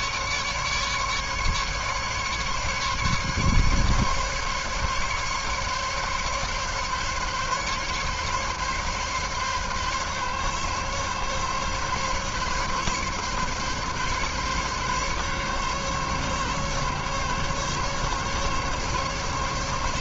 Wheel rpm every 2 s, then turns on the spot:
150, 140, 140, 140, 140, 140, 140, 140, 140, 140.
none